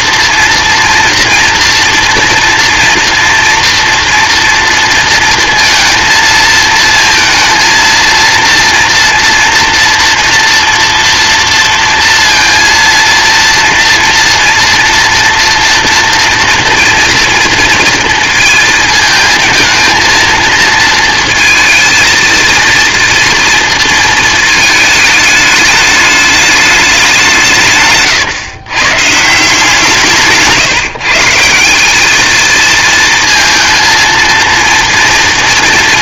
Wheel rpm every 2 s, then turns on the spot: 230, 230, 230, 230, 230, 240, 230, 230, 230, 230, 230, 230, 220, 210, 130, 160, 220, 230.
none